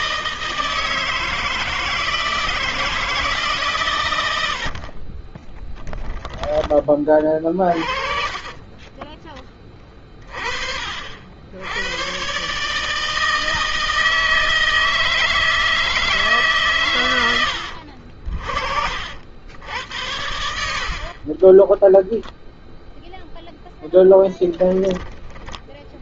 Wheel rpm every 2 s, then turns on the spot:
160, 140, 20, 30, 20, 80, 160, 160, 90, 70, 30, 0, 10.
4-8 20-22